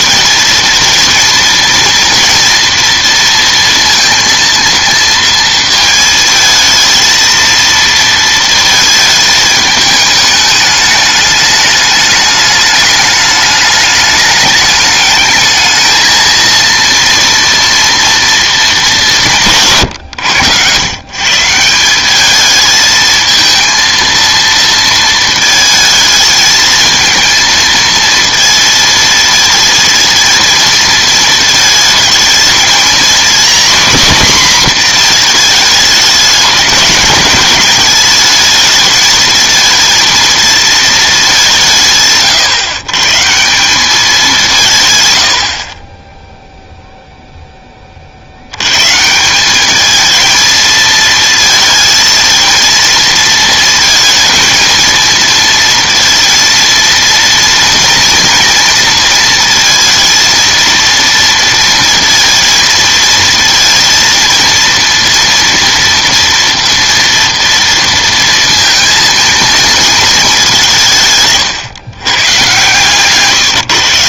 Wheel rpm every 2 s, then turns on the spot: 230, 230, 230, 220, 220, 210, 210, 210, 230, 210, 130, 220, 230, 220, 220, 230, 230, 240, 210, 220, 220, 130, 140, 0, 120, 220, 230, 230, 230, 230, 230, 220, 230, 230, 230, 170, 130.
72-74